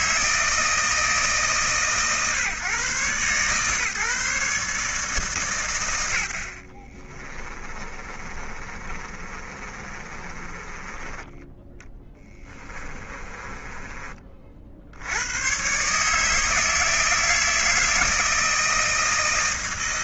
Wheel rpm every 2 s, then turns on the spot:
160, 140, 150, 70, 30, 20, 20, 60, 160, 160.
6-14